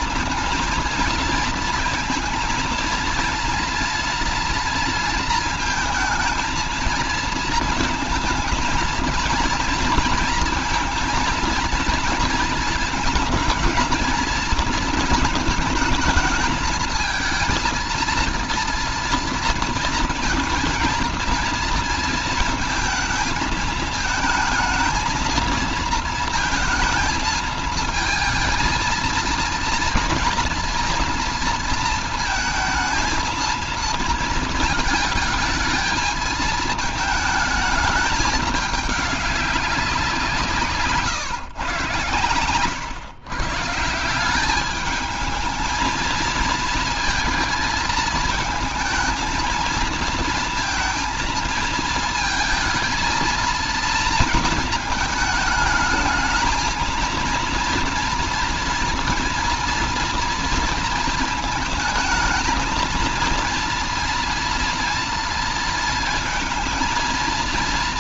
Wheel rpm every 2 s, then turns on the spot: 230, 230, 230, 220, 230, 230, 220, 220, 220, 230, 220, 230, 220, 220, 230, 240, 220, 220, 220, 210, 150, 110, 210, 220, 220, 220, 230, 220, 220, 230, 230, 230, 230, 220.
none